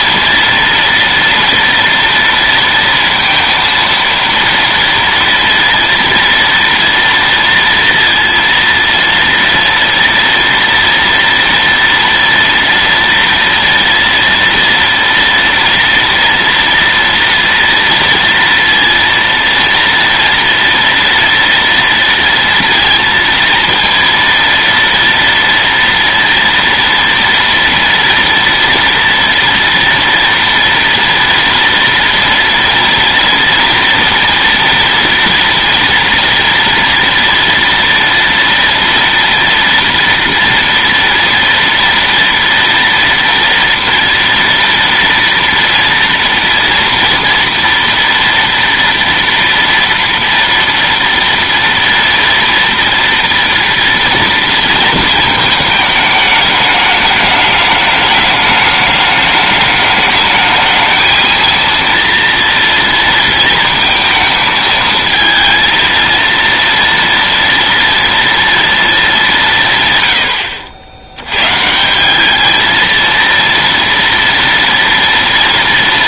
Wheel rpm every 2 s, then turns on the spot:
230, 230, 230, 230, 230, 230, 230, 240, 230, 230, 230, 230, 230, 230, 230, 230, 230, 230, 230, 230, 240, 230, 230, 230, 230, 230, 230, 230, 210, 210, 220, 230, 220, 230, 230, 80, 220, 230.
none